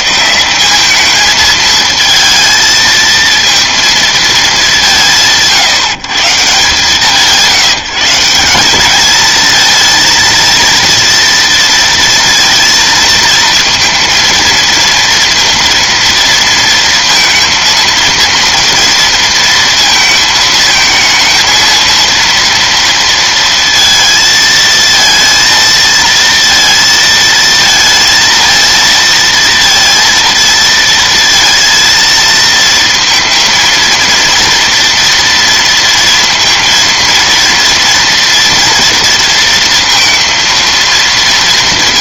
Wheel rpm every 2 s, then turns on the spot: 190, 230, 200, 160, 190, 230, 230, 230, 230, 230, 220, 230, 230, 230, 230, 230, 230, 230, 230, 230, 230.
none